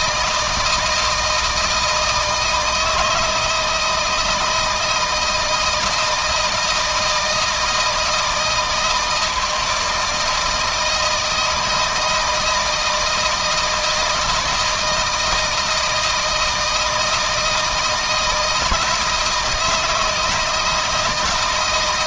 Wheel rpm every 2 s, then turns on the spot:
160, 160, 160, 160, 160, 160, 160, 160, 160, 160, 160.
none